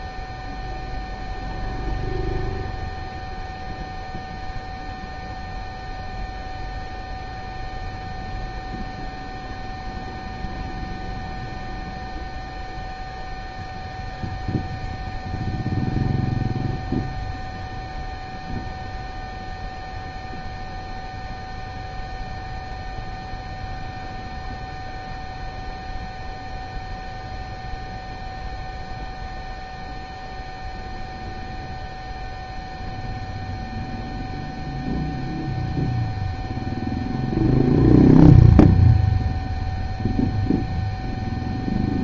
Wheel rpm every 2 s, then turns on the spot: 0, 0, 0, 0, 0, 0, 0, 0, 0, 0, 0, 0, 0, 0, 0, 0, 0, 0, 0, 0, 0.
none